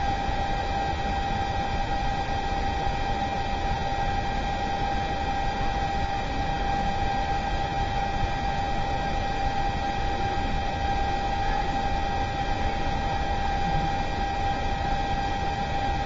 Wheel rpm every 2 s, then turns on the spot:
0, 0, 0, 0, 0, 0, 0, 0.
none